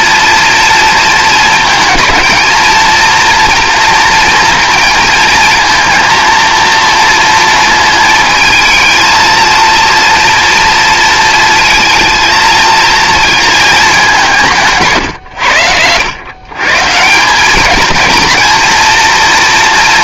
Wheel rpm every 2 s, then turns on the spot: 230, 230, 230, 230, 220, 230, 230, 140, 140, 230.
14-16